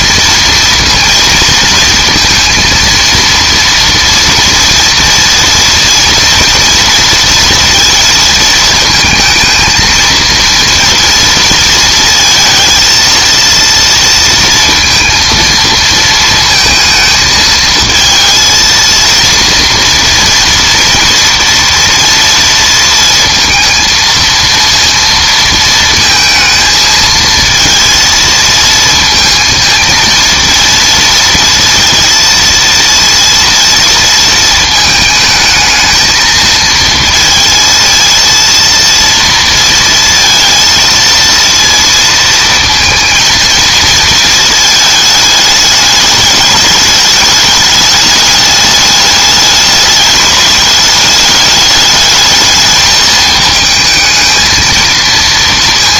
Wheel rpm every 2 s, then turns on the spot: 230, 230, 230, 230, 220, 230, 220, 230, 220, 230, 230, 230, 230, 220, 230, 230, 230, 220, 220, 230, 230, 230, 220, 210, 210, 210, 210, 230.
none